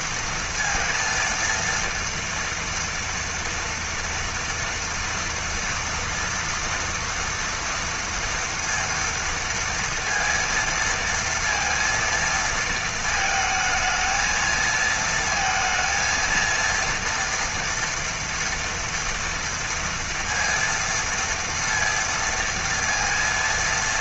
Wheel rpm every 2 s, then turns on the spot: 230, 230, 230, 230, 230, 230, 230, 220, 230, 230, 230, 230.
none